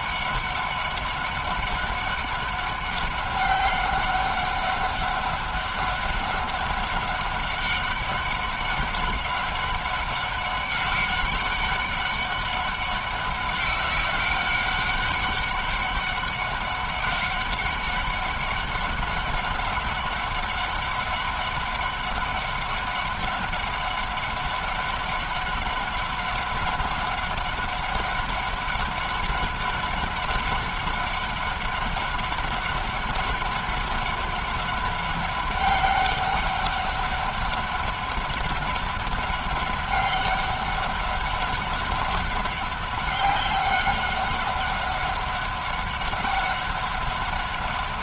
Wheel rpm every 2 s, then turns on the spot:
200, 200, 200, 200, 190, 190, 200, 200, 190, 200, 190, 200, 200, 190, 200, 200, 190, 200, 200, 190, 190, 190, 190, 200.
none